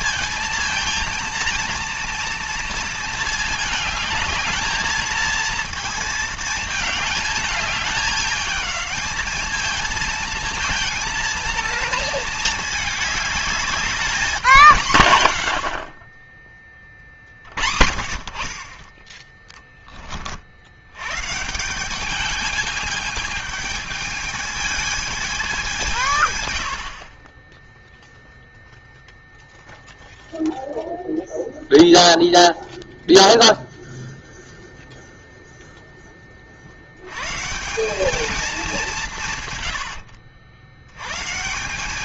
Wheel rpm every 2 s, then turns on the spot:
220, 230, 220, 220, 210, 230, 220, 170, 20, 30, 60, 210, 220, 90, 0, 0, 0, 0, 50, 210, 80.
none